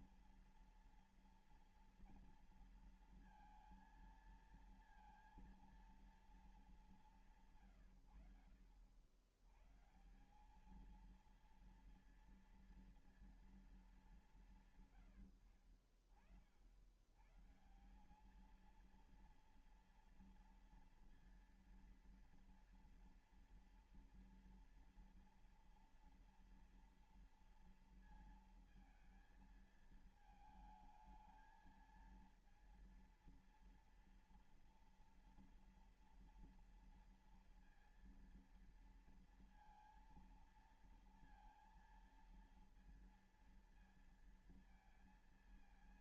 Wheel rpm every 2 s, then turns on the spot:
230, 230, 230, 220, 100, 190, 230, 170, 70, 210, 230, 230, 230, 240, 230, 220, 230, 230, 230, 230, 230, 230, 230.
none